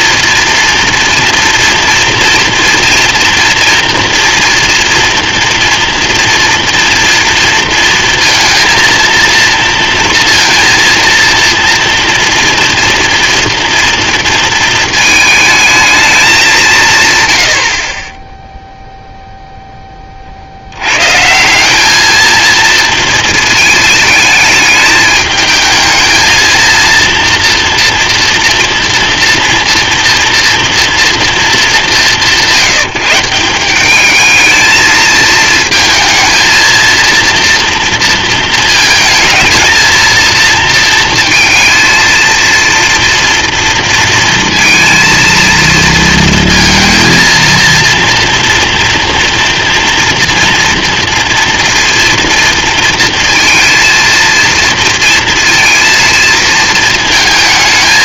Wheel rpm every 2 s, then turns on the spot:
230, 240, 240, 230, 230, 230, 230, 220, 190, 0, 80, 230, 210, 230, 230, 230, 170, 220, 230, 230, 230, 230, 230, 230, 230, 230, 230, 230, 230.
none